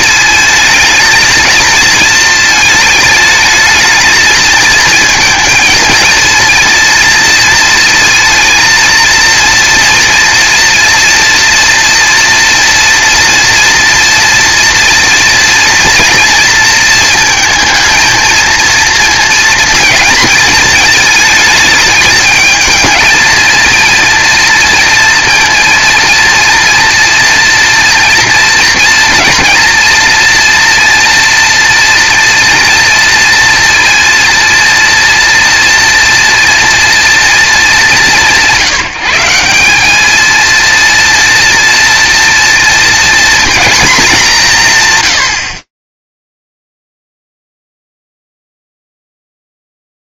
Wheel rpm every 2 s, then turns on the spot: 220, 220, 230, 230, 230, 230, 230, 230, 230, 230, 220, 220, 230, 230, 230, 240, 230, 230, 240, 170, 230, 230, 130, 0, 0.
none